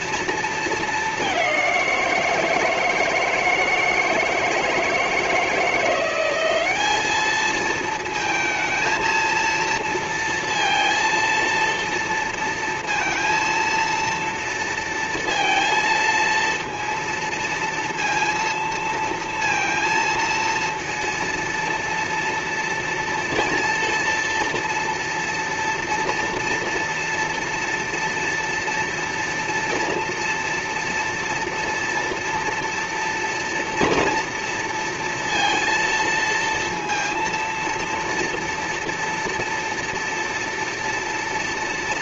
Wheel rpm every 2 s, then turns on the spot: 230, 170, 160, 180, 220, 230, 230, 230, 230, 230, 230, 230, 230, 230, 230, 240, 230, 230, 230, 230, 230.
none